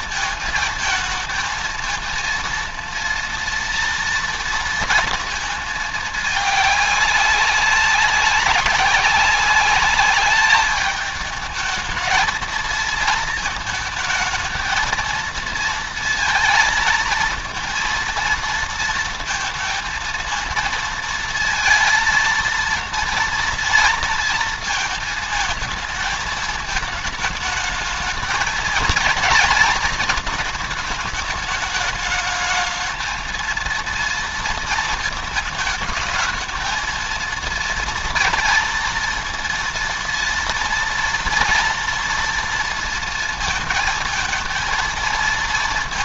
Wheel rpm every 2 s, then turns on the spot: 220, 230, 230, 210, 190, 210, 220, 220, 230, 230, 230, 230, 230, 220, 220, 220, 220, 230, 230, 230, 230, 230, 230.
none